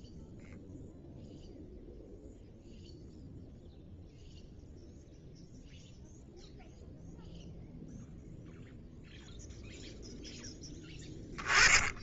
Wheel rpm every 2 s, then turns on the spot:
10, 0, 0, 0, 0, 10.
10-12